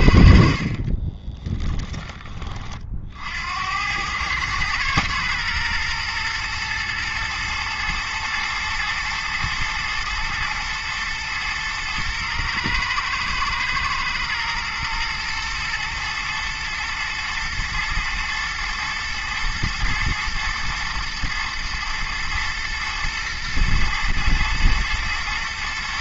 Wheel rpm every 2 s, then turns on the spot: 40, 50, 110, 110, 120, 110, 110, 110, 120, 120, 120, 120, 120.
0-2